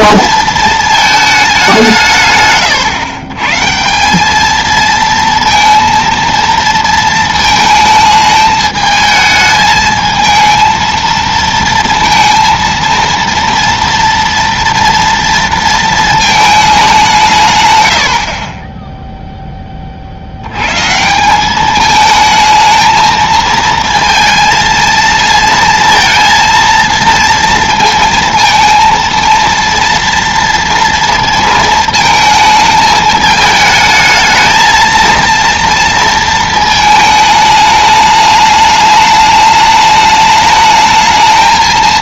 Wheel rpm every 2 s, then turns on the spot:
220, 120, 220, 230, 220, 230, 230, 230, 210, 30, 100, 220, 220, 230, 230, 230, 220, 220, 220, 210, 210.
none